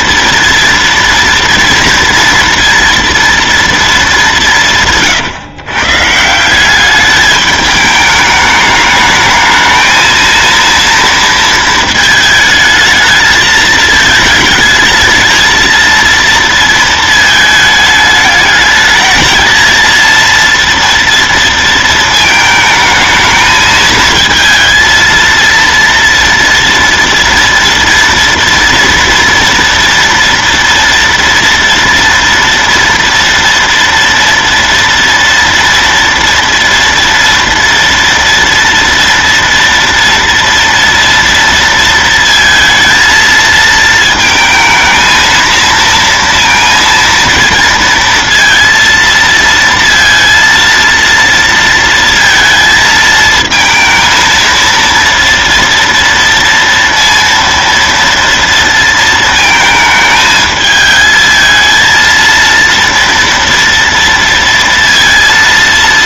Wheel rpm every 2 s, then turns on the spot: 230, 230, 200, 160, 210, 230, 220, 220, 230, 210, 230, 220, 220, 230, 230, 230, 230, 230, 230, 230, 230, 230, 220, 230, 230, 230, 230, 230, 230, 230, 220, 230, 230.
none